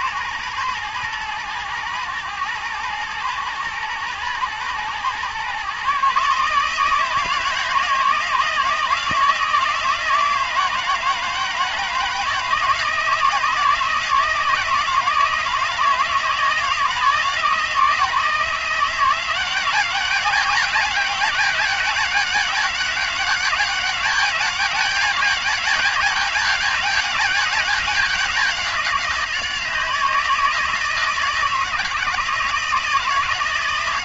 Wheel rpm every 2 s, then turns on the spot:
110, 110, 120, 150, 160, 160, 160, 160, 160, 180, 200, 190, 200, 200, 180, 160, 160.
none